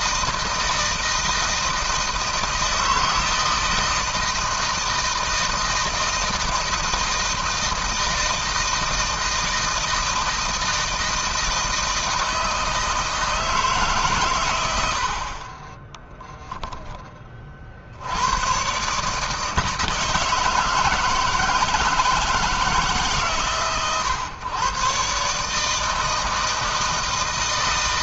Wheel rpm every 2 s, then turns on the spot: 160, 160, 160, 160, 160, 160, 160, 80, 20, 140, 160, 160, 140, 160.
none